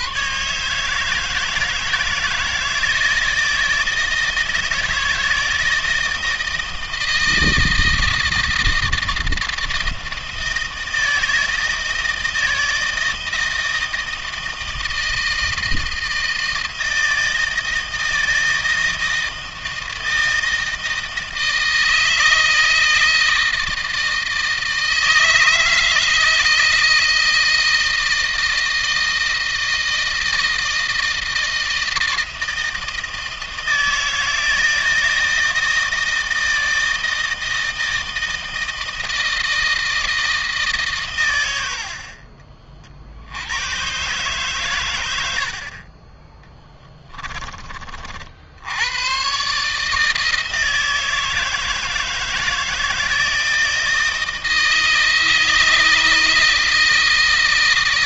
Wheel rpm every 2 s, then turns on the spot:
150, 160, 160, 160, 160, 160, 160, 160, 160, 160, 160, 160, 160, 160, 160, 160, 160, 160, 160, 160, 150, 50, 120, 30, 90, 160, 160, 160, 160.
46-48